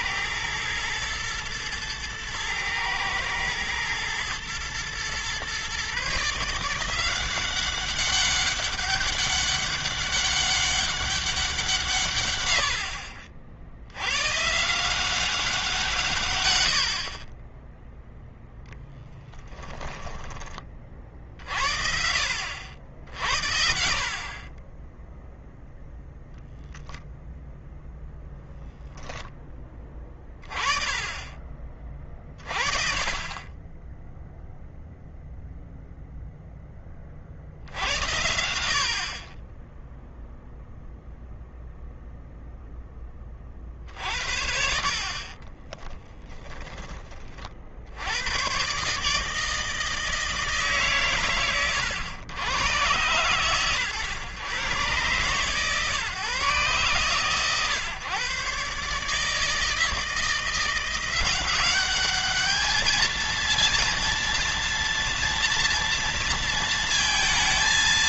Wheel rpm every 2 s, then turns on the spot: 110, 110, 120, 170, 200, 190, 50, 170, 70, 10, 40, 70, 10, 0, 0, 30, 40, 0, 30, 40, 0, 10, 50, 20, 140, 140, 110, 120, 130, 140, 170, 220, 230, 230.
44-46